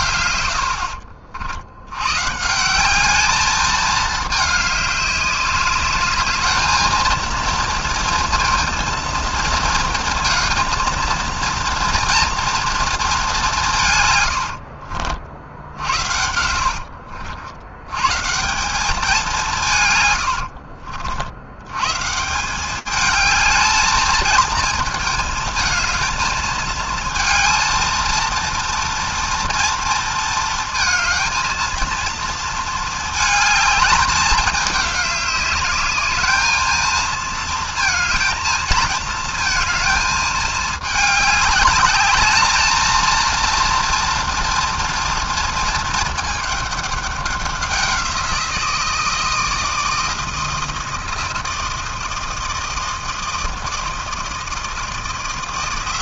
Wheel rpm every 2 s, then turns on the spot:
90, 160, 210, 220, 230, 220, 230, 90, 70, 180, 70, 170, 220, 220, 230, 230, 220, 210, 220, 230, 220, 220, 230, 210, 170, 160, 160, 160.
14-18 20-22